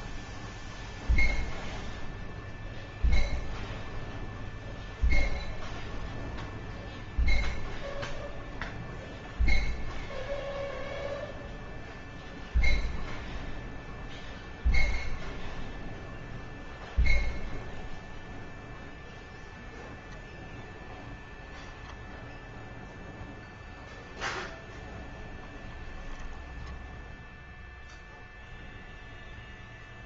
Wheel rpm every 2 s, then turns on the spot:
0, 0, 0, 0, 0, 0, 0, 0, 0, 0, 10, 0, 10, 10, 0.
20-22